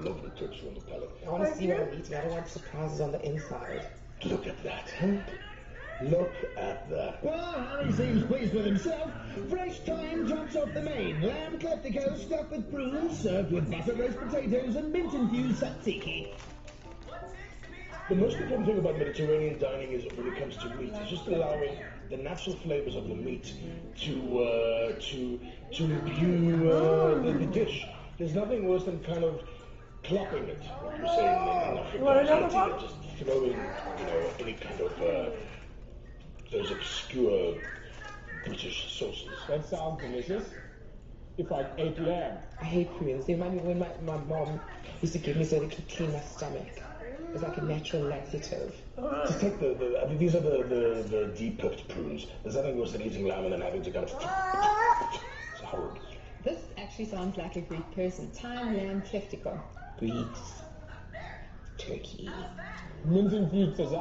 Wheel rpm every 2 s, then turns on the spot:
0, 0, 0, 0, 0, 0, 0, 0, 0, 0, 0, 0, 0, 0, 0, 0, 0, 0, 0, 0, 0, 0, 0, 0, 0, 0, 0, 0, 0, 0, 0, 0.
none